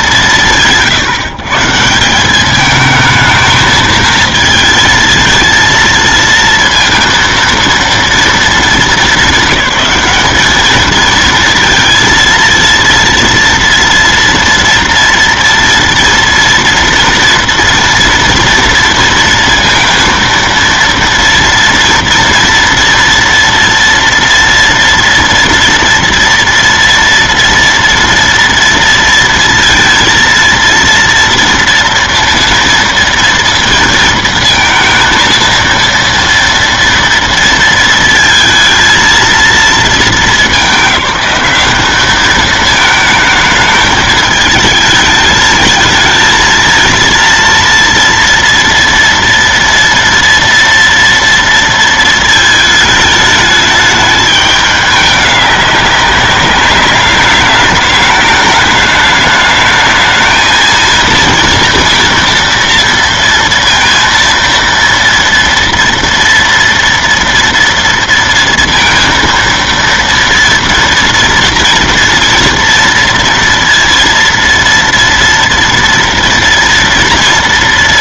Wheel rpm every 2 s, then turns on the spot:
200, 190, 220, 230, 230, 210, 230, 230, 230, 240, 230, 230, 230, 230, 230, 230, 230, 230, 230, 230, 220, 210, 220, 220, 230, 230, 220, 210, 200, 210, 220, 230, 230, 230, 230, 230, 230, 230, 230.
none